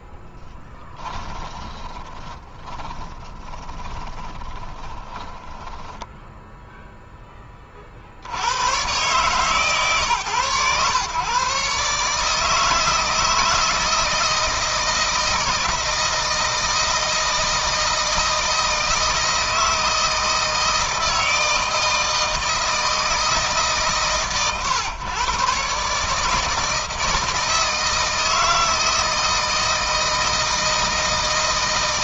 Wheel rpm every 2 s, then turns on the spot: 20, 20, 20, 0, 110, 120, 160, 160, 160, 160, 160, 160, 130, 160, 160, 160.
0-6